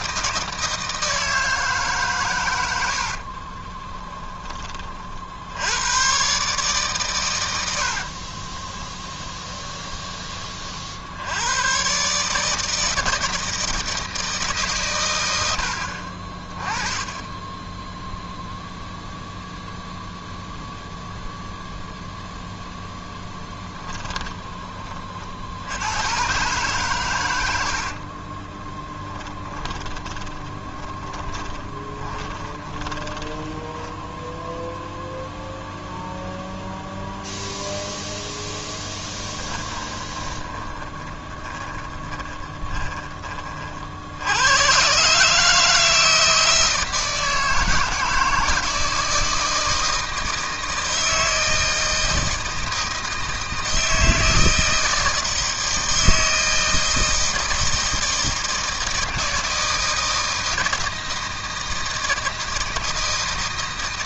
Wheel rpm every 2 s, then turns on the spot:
160, 70, 30, 140, 20, 50, 160, 130, 20, 0, 0, 0, 20, 120, 20, 20, 20, 0, 0, 20, 20, 20, 90, 160, 160, 160, 160, 160, 160, 160, 160, 160.
2-4 8-10 24-26 28-34 38-44